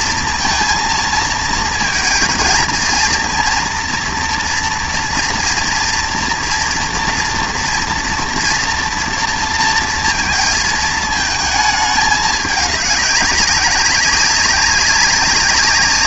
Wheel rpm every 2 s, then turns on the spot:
230, 220, 230, 230, 230, 220, 210, 190.
none